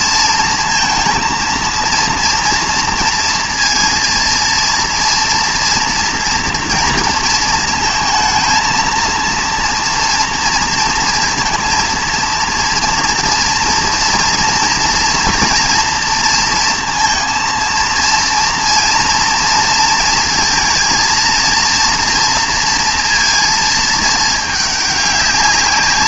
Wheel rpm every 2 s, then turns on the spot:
230, 230, 230, 230, 230, 230, 230, 230, 230, 230, 230, 230, 210.
none